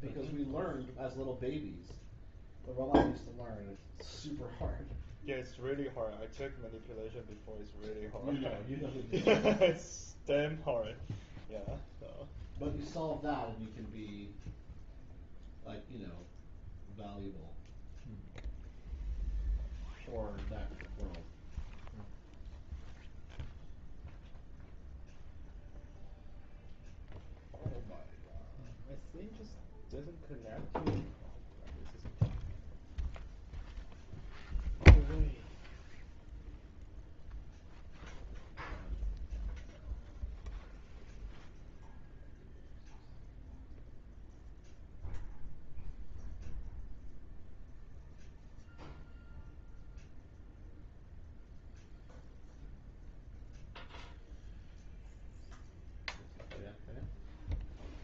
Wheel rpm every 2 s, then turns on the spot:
0, 0, 0, 0, 0, 0, 0, 0, 0, 0, 0, 0, 0, 0, 0, 0, 0, 0, 0, 0, 0, 0, 0, 0, 0, 0, 0, 0, 0.
none